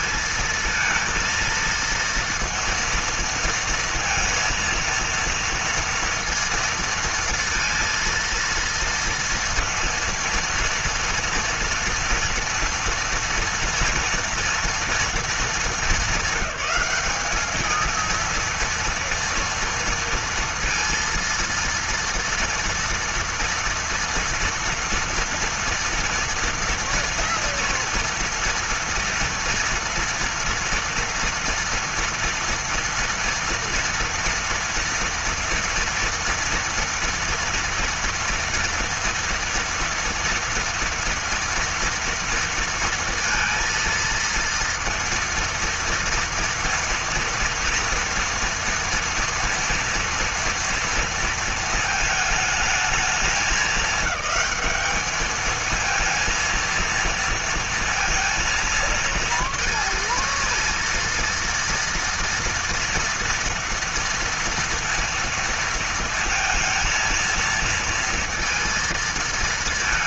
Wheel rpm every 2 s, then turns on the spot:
230, 230, 230, 230, 230, 230, 230, 230, 220, 230, 230, 230, 230, 230, 230, 230, 230, 230, 230, 240, 230, 230, 230, 230, 230, 230, 220, 210, 230, 230, 230, 230, 230, 230, 230.
none